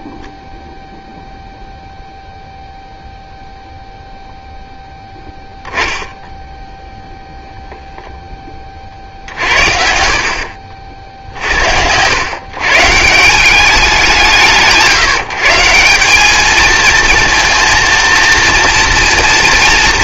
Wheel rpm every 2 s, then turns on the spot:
0, 0, 0, 0, 60, 60, 180, 170, 230, 240.
none